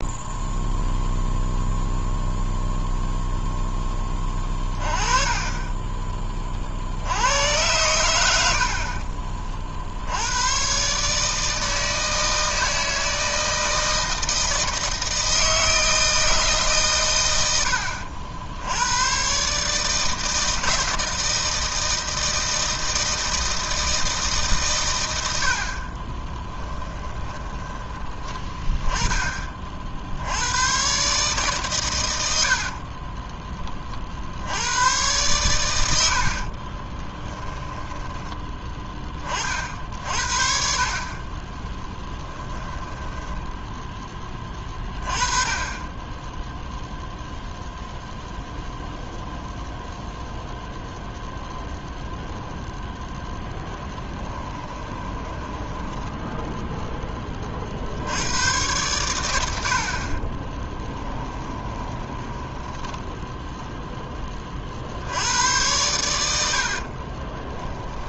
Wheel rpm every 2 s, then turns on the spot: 0, 0, 20, 60, 50, 130, 160, 160, 130, 100, 160, 160, 110, 10, 10, 130, 40, 110, 20, 20, 50, 10, 30, 0, 0, 0, 0, 20, 10, 110, 10, 10, 70, 40.
26-28 32-34 36-38 42-44 54-56 60-64 66-68